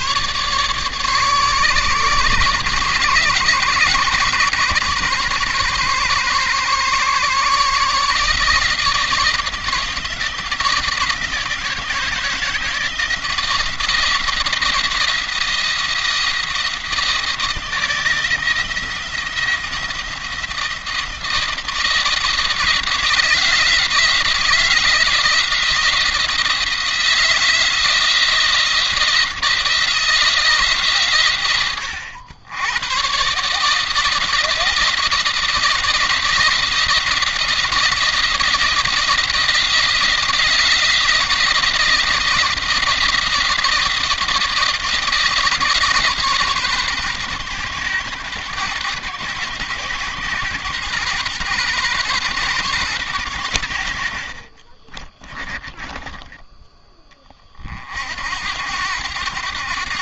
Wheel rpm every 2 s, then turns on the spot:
150, 120, 130, 130, 160, 160, 160, 170, 170, 170, 170, 160, 170, 160, 170, 130, 120, 170, 160, 170, 170, 170, 170, 130, 130, 130, 120, 30, 30, 90.
54-56